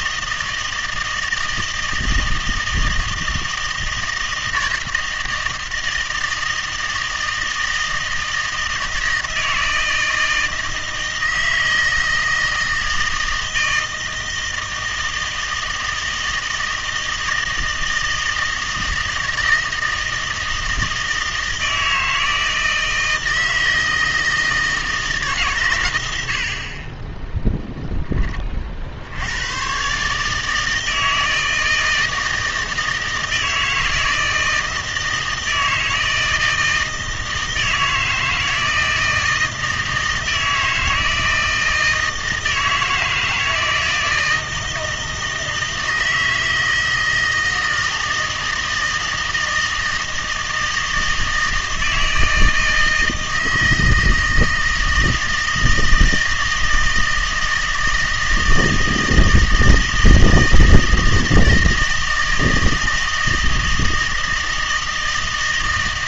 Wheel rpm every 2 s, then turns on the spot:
160, 160, 160, 160, 160, 160, 160, 160, 160, 160, 160, 160, 160, 40, 40, 160, 160, 160, 160, 160, 160, 160, 160, 160, 160, 160, 160, 160, 160, 160, 160, 160, 160.
none